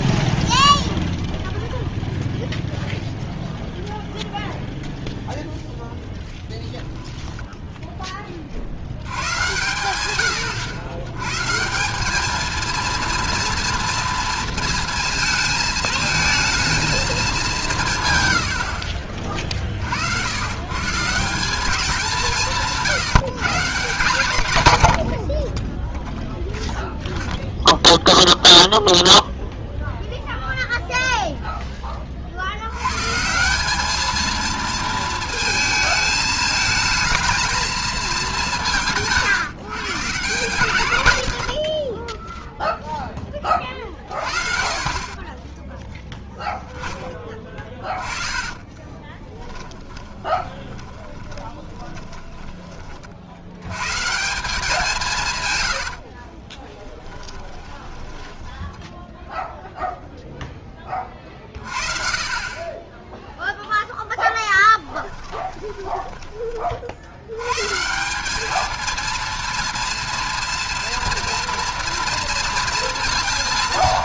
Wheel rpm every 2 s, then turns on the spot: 0, 0, 0, 0, 100, 110, 230, 230, 220, 50, 170, 160, 60, 0, 0, 0, 100, 220, 220, 180, 150, 0, 40, 10, 20, 20, 20, 180, 30, 10, 10, 30, 10, 20, 200, 240, 230.
18-20 48-52 56-60